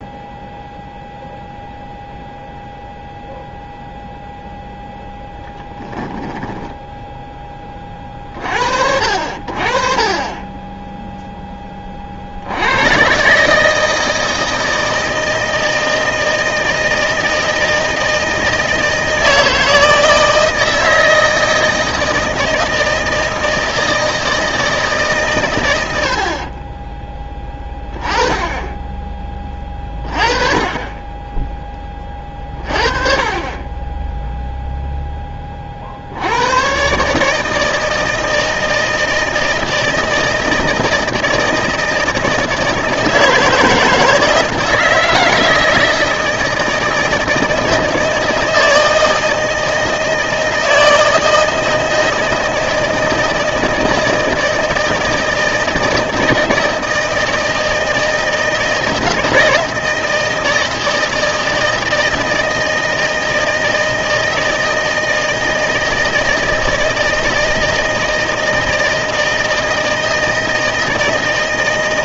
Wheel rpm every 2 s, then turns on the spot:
0, 0, 0, 10, 50, 10, 90, 160, 160, 160, 160, 160, 160, 30, 20, 30, 30, 0, 120, 160, 160, 160, 160, 160, 160, 160, 160, 160, 160, 160, 160, 160, 160, 160, 160, 170.
6-8